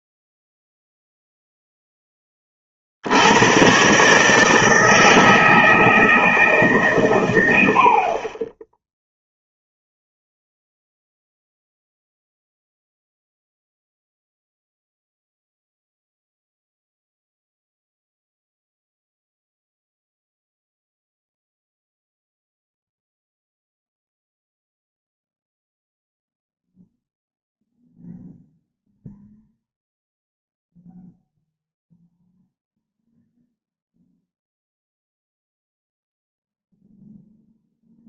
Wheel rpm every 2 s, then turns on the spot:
0, 30, 160, 150, 10, 0, 0, 0, 0, 0, 0, 0, 0, 0, 0, 0, 0, 0, 0.
none